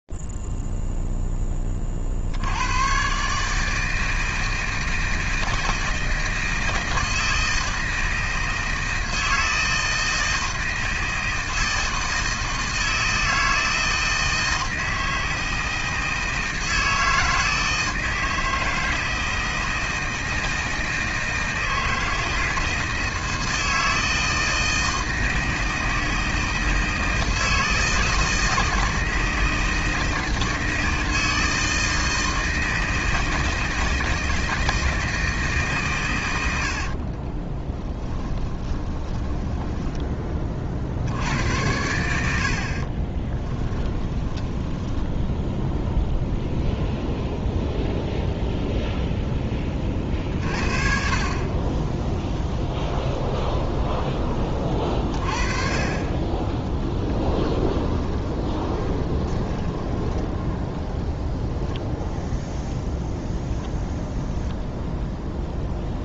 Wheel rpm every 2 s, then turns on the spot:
0, 40, 160, 160, 160, 160, 160, 160, 160, 160, 160, 160, 160, 160, 160, 160, 160, 160, 50, 20, 60, 40, 10, 0, 0, 50, 10, 30, 20, 20, 0, 0, 0.
36-40 42-46 52-54 58-60